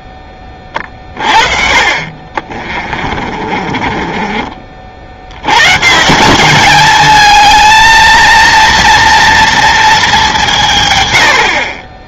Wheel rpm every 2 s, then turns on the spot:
20, 40, 40, 200, 230, 140.
0-4